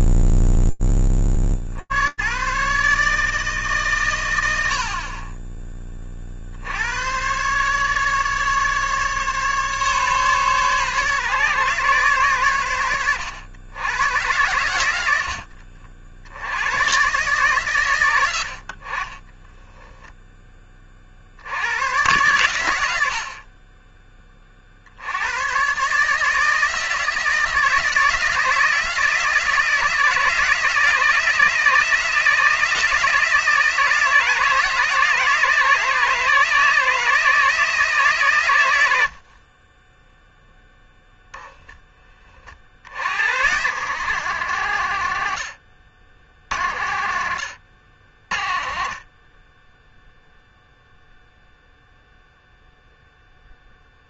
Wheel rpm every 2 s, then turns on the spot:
80, 150, 70, 70, 140, 140, 100, 90, 120, 40, 40, 80, 60, 160, 160, 160, 160, 160, 160, 70, 0, 70, 120, 80, 40, 0, 0.
none